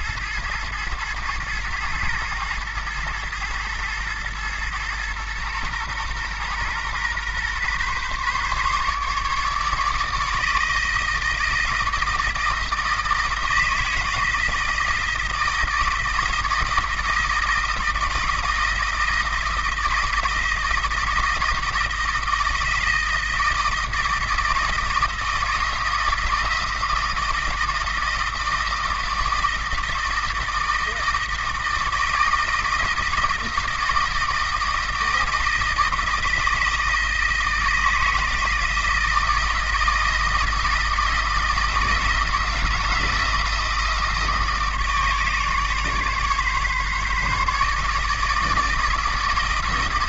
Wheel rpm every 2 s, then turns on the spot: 110, 110, 120, 120, 140, 160, 160, 160, 160, 160, 160, 160, 160, 160, 160, 160, 160, 160, 160, 160, 160, 160, 160, 140, 160.
none